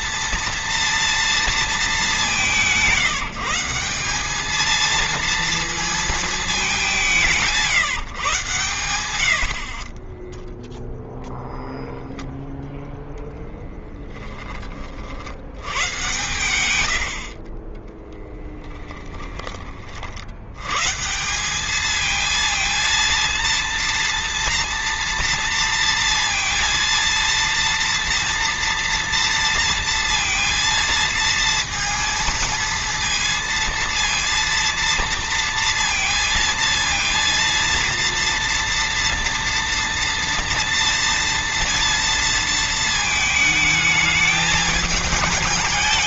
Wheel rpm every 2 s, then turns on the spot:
230, 170, 220, 190, 100, 0, 0, 40, 100, 20, 130, 230, 230, 230, 230, 230, 230, 230, 230, 230, 230, 220, 210.
16-20